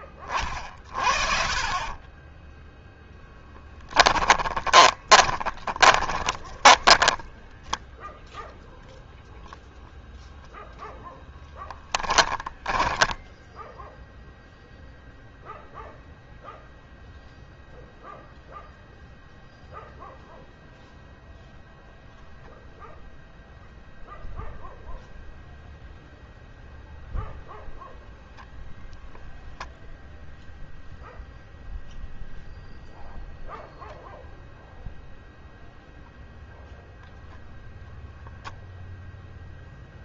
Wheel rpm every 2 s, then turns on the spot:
30, 10, 20, 20, 0, 0, 10, 0, 0, 0, 0, 0, 0, 0, 0, 0, 0, 0, 0, 0.
2-8 12-14